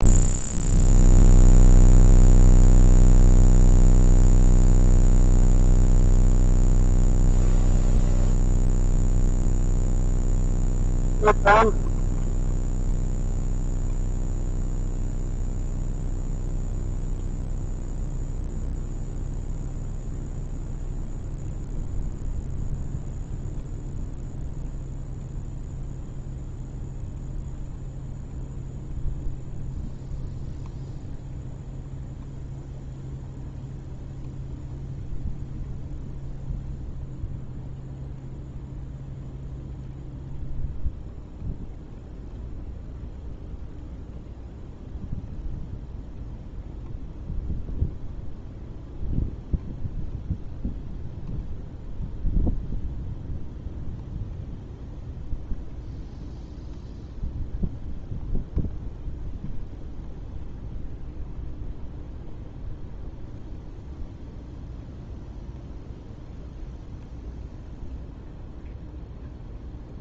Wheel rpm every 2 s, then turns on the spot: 0, 0, 0, 0, 0, 0, 0, 0, 0, 0, 0, 0, 0, 0, 0, 0, 0, 0, 0, 0, 0, 0, 0, 0, 0, 0, 0, 0, 0, 0, 0, 0, 0, 0, 0.
none